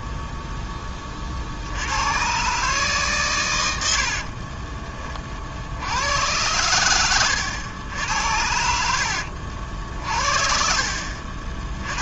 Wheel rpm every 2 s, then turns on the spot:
20, 140, 30, 100, 70, 50.
8-10